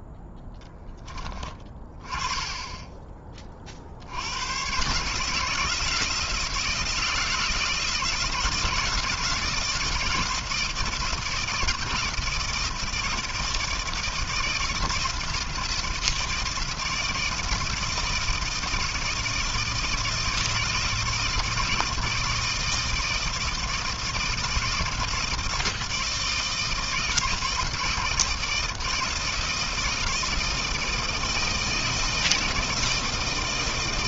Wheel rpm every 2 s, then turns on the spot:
20, 30, 160, 160, 160, 160, 160, 160, 160, 170, 160, 160, 160, 160, 160, 160, 160.
none